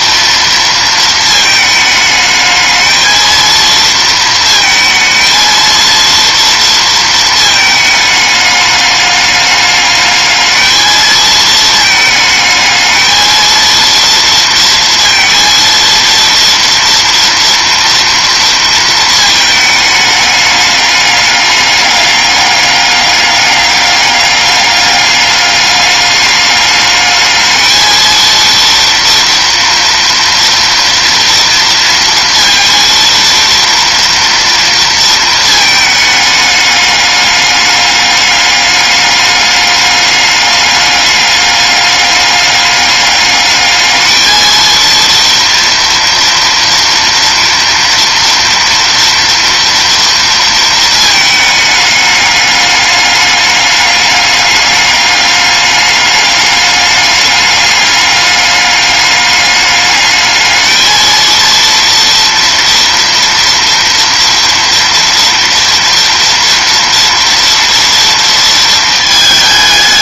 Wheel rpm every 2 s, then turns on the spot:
230, 220, 220, 230, 210, 220, 220, 230, 230, 230, 200, 200, 200, 210, 230, 230, 230, 230, 210, 210, 200, 200, 230, 230, 230, 220, 210, 200, 200, 200, 220, 230, 230, 230, 220.
none